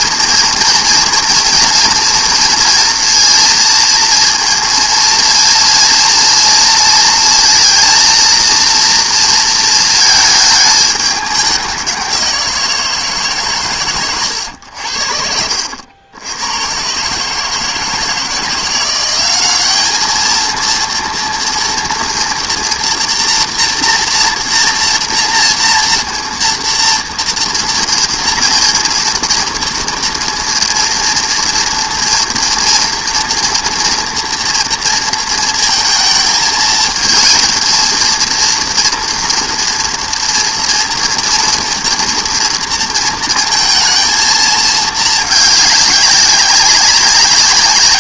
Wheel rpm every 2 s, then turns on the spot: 230, 230, 230, 230, 230, 210, 180, 90, 100, 170, 220, 230, 230, 230, 230, 230, 230, 230, 220, 230, 230, 230, 220, 190.
none